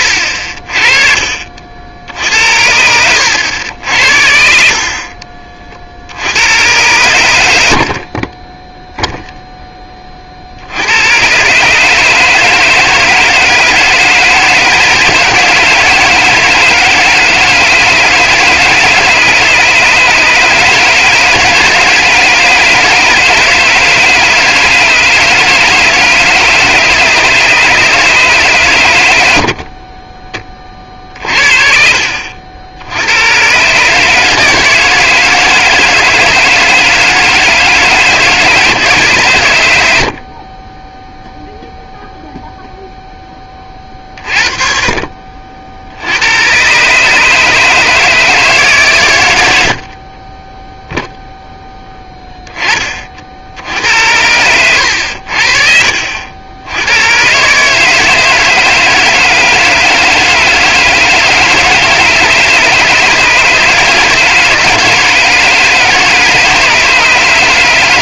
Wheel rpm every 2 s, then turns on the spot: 50, 70, 50, 100, 10, 70, 160, 160, 160, 150, 160, 160, 150, 150, 130, 30, 70, 160, 160, 150, 20, 0, 40, 130, 150, 10, 20, 90, 80, 160, 160, 150, 160, 150.
8-10 40-42